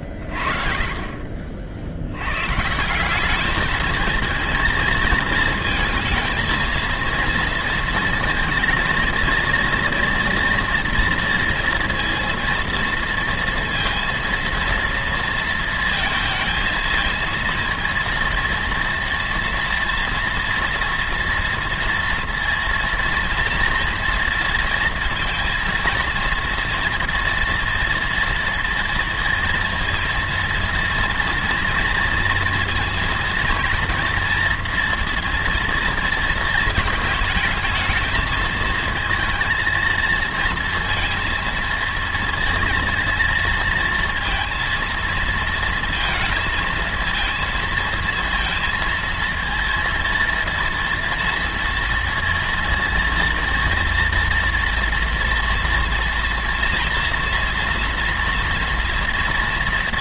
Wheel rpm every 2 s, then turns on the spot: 30, 170, 230, 230, 230, 230, 230, 230, 220, 230, 240, 230, 230, 230, 230, 230, 230, 230, 220, 220, 230, 230, 230, 230, 230, 230, 230, 230, 230, 230.
none